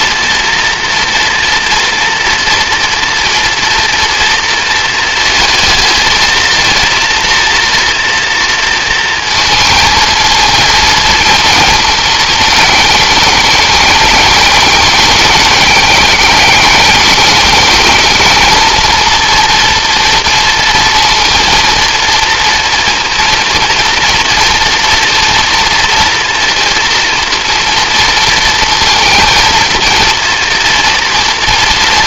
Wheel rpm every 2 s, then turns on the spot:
230, 240, 230, 230, 230, 230, 210, 210, 210, 230, 230, 230, 230, 230, 230, 230.
none